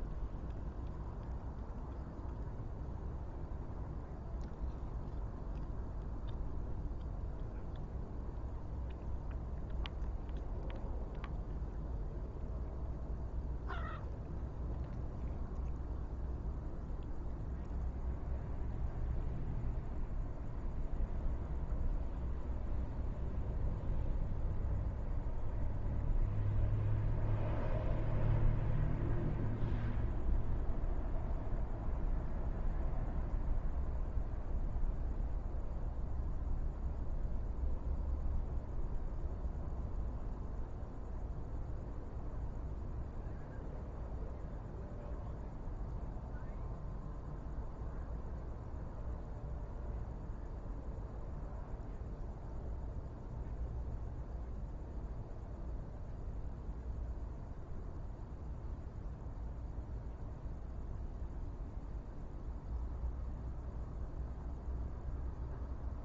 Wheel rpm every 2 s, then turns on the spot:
0, 0, 0, 0, 0, 0, 0, 0, 0, 0, 0, 0, 0, 0, 0, 0, 0, 0, 0, 0, 0, 0, 0, 0, 0, 0, 0, 0, 0, 0, 0, 0, 0.
none